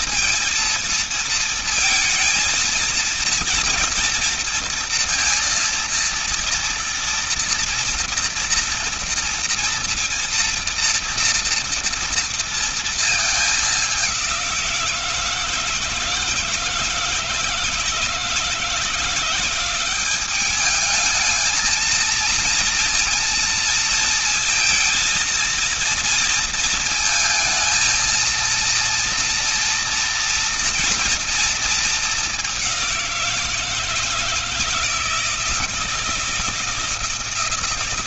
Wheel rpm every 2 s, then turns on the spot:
230, 230, 230, 230, 230, 230, 230, 180, 160, 170, 210, 230, 230, 230, 230, 230, 200, 160, 160.
none